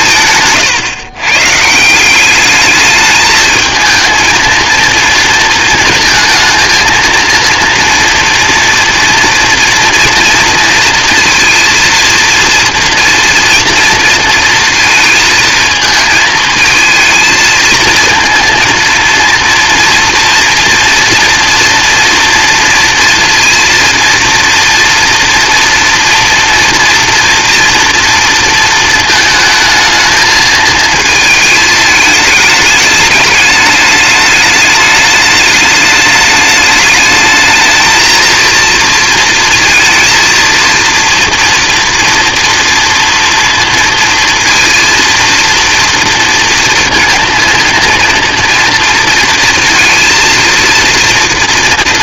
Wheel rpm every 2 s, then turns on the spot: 140, 210, 230, 230, 230, 230, 230, 230, 220, 230, 230, 230, 230, 240, 230, 220, 210, 210, 210, 230, 230, 230, 230, 230, 230, 230.
0-2